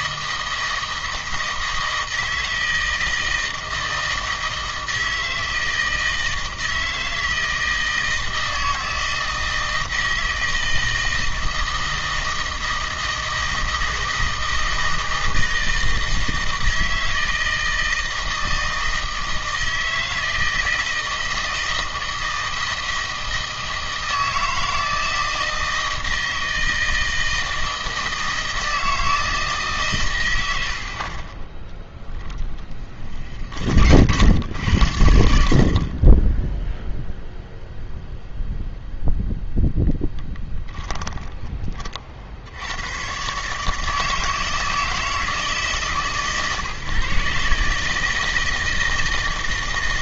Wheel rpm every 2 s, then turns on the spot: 160, 160, 160, 160, 160, 160, 160, 160, 160, 160, 160, 160, 160, 160, 160, 70, 30, 80, 0, 0, 10, 100, 160, 140, 160.
30-34 40-42